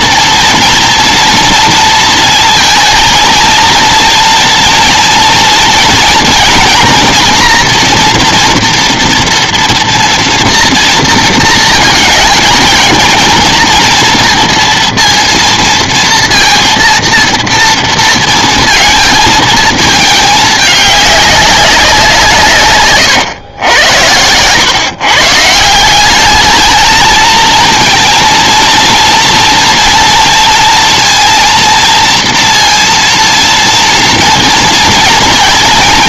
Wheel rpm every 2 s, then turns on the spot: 230, 230, 230, 230, 240, 230, 220, 230, 230, 230, 220, 170, 110, 190, 230, 230, 230, 230.
none